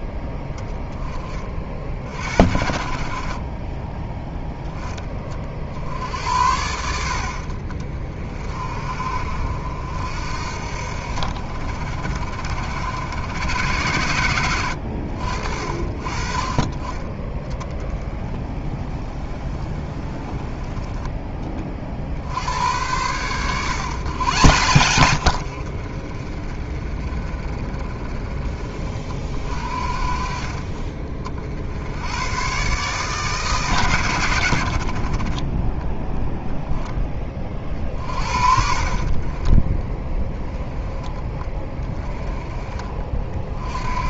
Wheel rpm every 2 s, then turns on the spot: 10, 60, 10, 70, 40, 60, 70, 90, 30, 20, 20, 80, 120, 40, 30, 40, 130, 90, 10, 60, 10, 30.
none